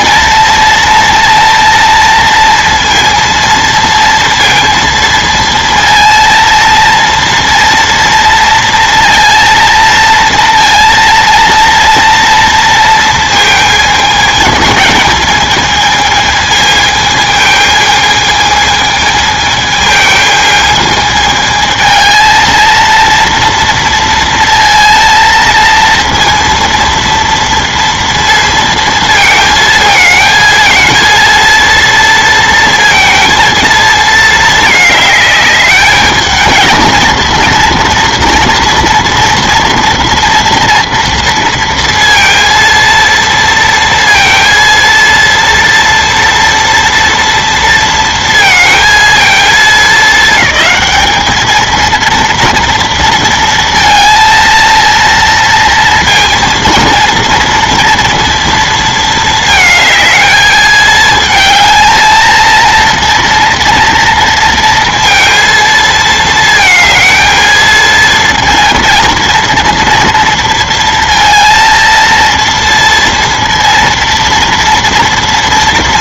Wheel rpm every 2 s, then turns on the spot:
230, 230, 230, 230, 230, 230, 230, 220, 220, 220, 220, 230, 230, 230, 230, 220, 230, 220, 230, 230, 230, 230, 230, 230, 220, 210, 230, 230, 230, 220, 220, 230, 230, 220, 230, 230, 230, 230.
none